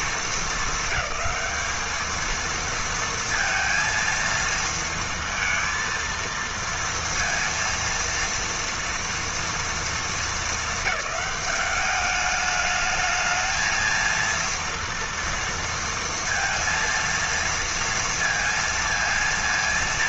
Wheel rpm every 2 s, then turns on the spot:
210, 230, 230, 230, 230, 210, 210, 230, 230, 230.
none